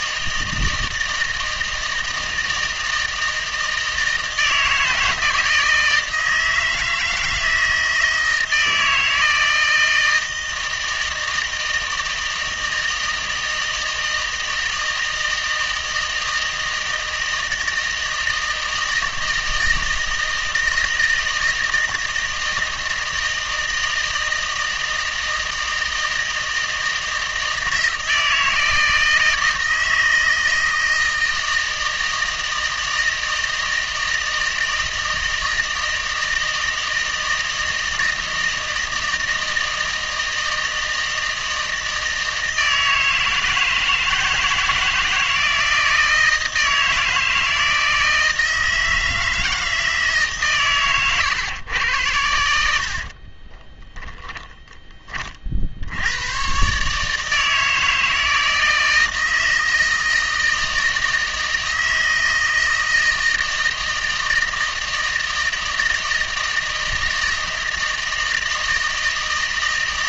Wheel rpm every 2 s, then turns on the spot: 160, 160, 160, 160, 160, 160, 160, 160, 160, 160, 160, 160, 160, 160, 160, 160, 160, 160, 160, 160, 160, 160, 160, 160, 160, 120, 70, 20, 140, 160, 160, 160, 160, 160, 160.
none